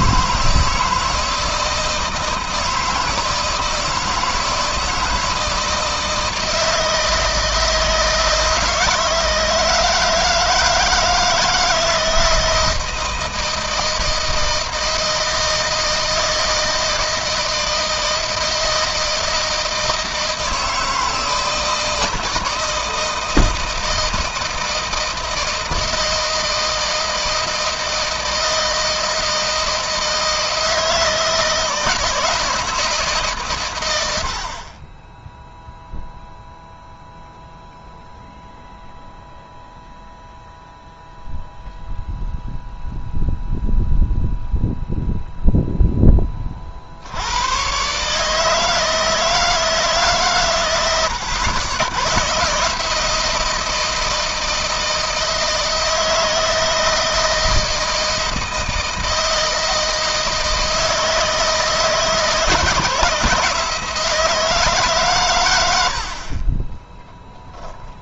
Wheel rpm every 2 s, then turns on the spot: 160, 160, 160, 160, 160, 160, 160, 160, 160, 160, 160, 160, 160, 160, 160, 160, 160, 60, 0, 0, 0, 0, 0, 30, 150, 130, 140, 160, 160, 160, 160, 160, 160, 40.
none